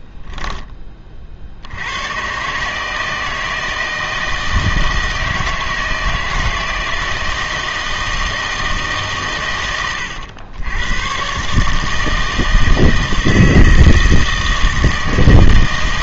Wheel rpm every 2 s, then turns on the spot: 10, 150, 160, 160, 160, 100, 160, 160.
none